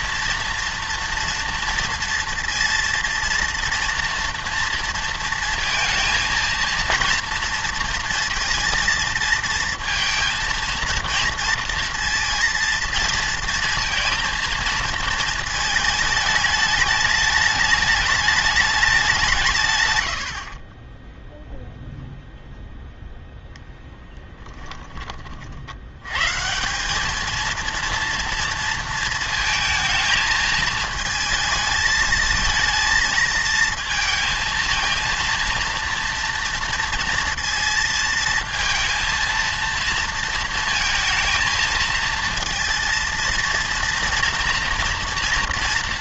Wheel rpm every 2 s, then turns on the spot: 230, 230, 230, 230, 230, 230, 230, 230, 210, 200, 40, 0, 10, 170, 230, 220, 220, 230, 230, 230, 220, 230, 230.
none